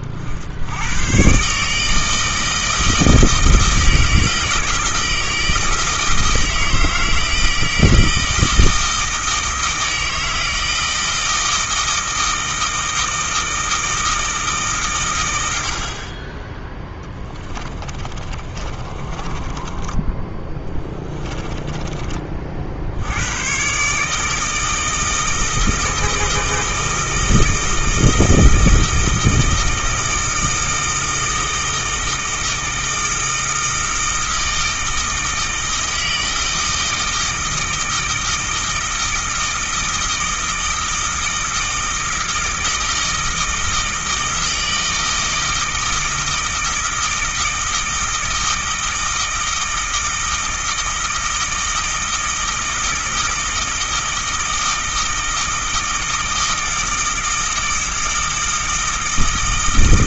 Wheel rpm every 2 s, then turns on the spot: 90, 160, 160, 160, 160, 160, 160, 150, 10, 30, 10, 60, 160, 160, 160, 160, 160, 160, 160, 160, 160, 160, 160, 160, 160, 160, 160, 160, 160, 160.
16-22